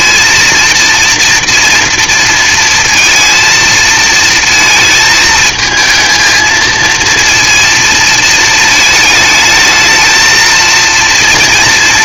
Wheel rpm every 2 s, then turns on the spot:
230, 230, 220, 230, 220, 220.
none